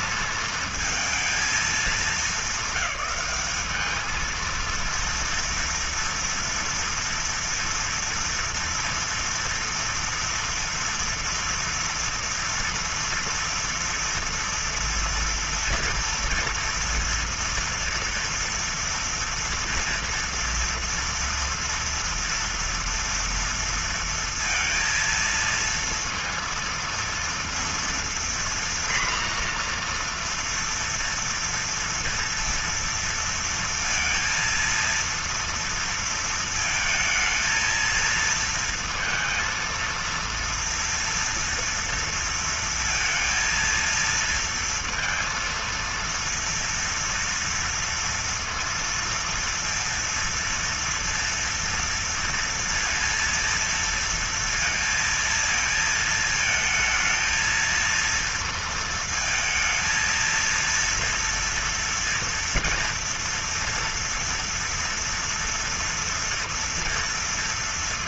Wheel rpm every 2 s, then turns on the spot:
220, 200, 220, 230, 230, 230, 230, 230, 230, 240, 230, 230, 230, 230, 240, 240, 230, 230, 220, 230, 230, 230, 230, 230, 230, 230, 230, 230, 220, 230, 230, 230, 230, 230.
none